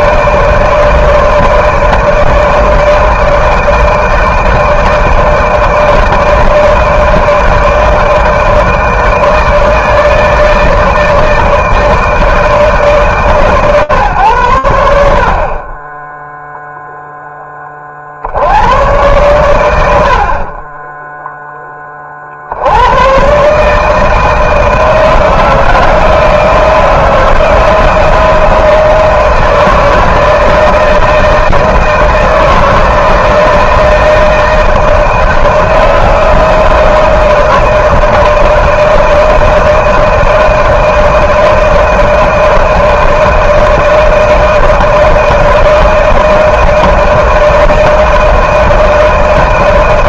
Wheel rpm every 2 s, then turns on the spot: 160, 160, 160, 160, 160, 160, 150, 100, 0, 90, 40, 90, 160, 160, 160, 160, 160, 160, 160, 160, 160, 160, 160, 160, 160.
none